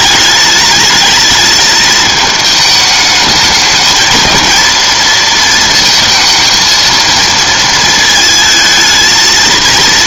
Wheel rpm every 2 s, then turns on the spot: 210, 220, 230, 220, 220.
none